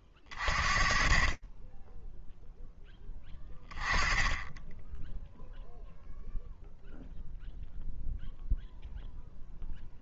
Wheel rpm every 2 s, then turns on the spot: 30, 10, 0, 0, 10.
none